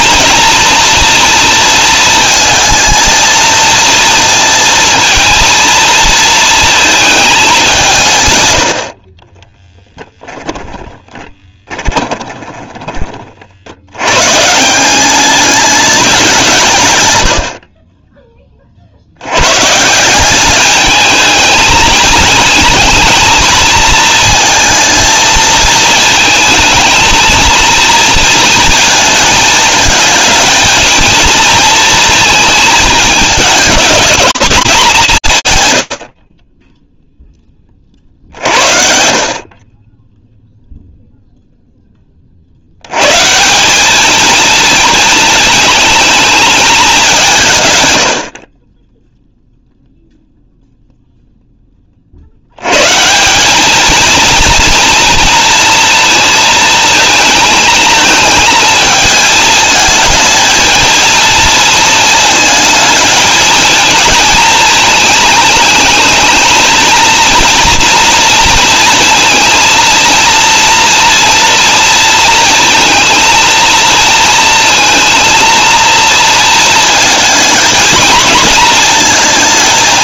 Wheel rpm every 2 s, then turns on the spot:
230, 220, 220, 230, 80, 10, 20, 150, 160, 40, 210, 220, 230, 220, 220, 220, 220, 200, 10, 60, 0, 140, 220, 170, 0, 0, 160, 230, 220, 220, 230, 220, 230, 230, 230, 230, 230, 230, 230, 230.
10-14